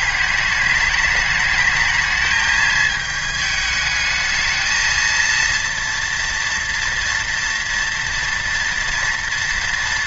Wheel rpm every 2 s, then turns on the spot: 210, 220, 220, 240, 240.
none